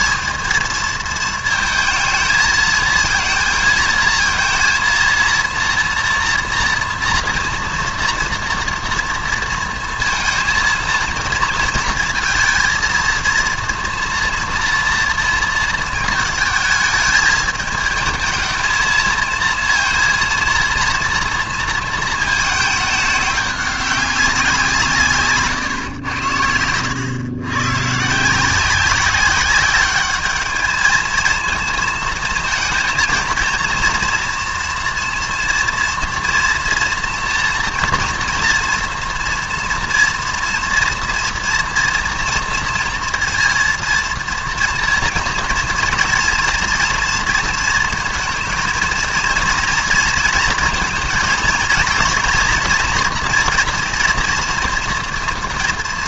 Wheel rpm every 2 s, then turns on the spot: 230, 220, 230, 230, 230, 230, 230, 230, 220, 220, 230, 220, 170, 90, 180, 210, 230, 240, 230, 230, 230, 230, 230, 230, 230, 230, 230, 230.
none